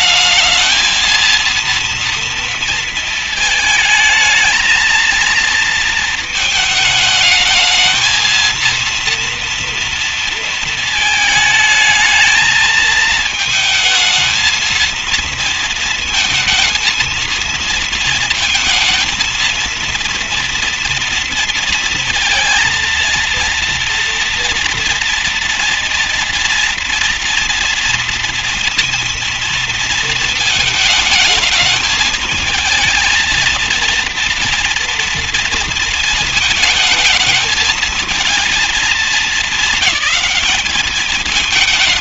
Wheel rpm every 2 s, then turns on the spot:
220, 230, 230, 220, 230, 230, 220, 220, 230, 230, 240, 230, 230, 230, 230, 230, 220, 230, 220, 230, 220.
none